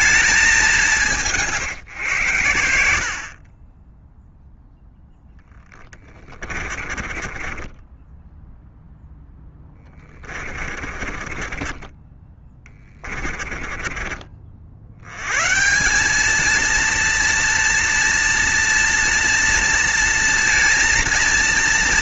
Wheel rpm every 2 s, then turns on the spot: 190, 70, 0, 30, 0, 30, 20, 70, 230, 230, 230.
6-8 10-14